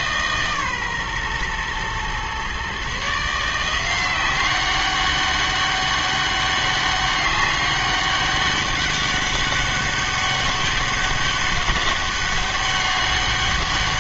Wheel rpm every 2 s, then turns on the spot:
140, 130, 190, 200, 200, 200, 200.
none